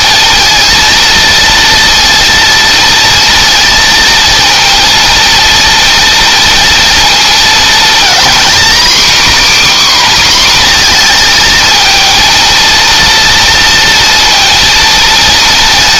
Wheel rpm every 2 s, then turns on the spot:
230, 230, 230, 230, 270, 240, 230, 230.
none